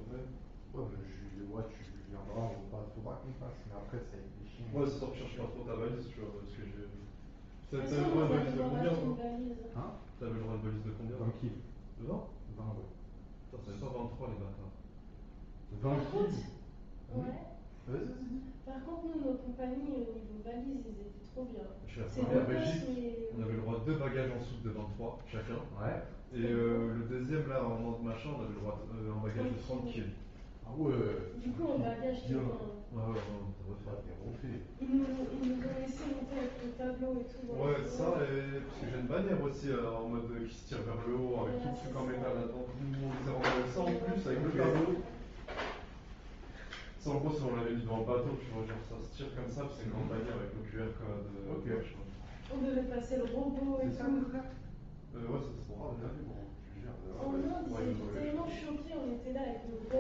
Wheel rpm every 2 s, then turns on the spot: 0, 0, 0, 0, 0, 0, 0, 0, 0, 0, 0, 0, 0, 0, 0, 0, 0, 0, 0, 0, 0, 0, 0, 0, 0, 0, 0, 0, 0, 0.
none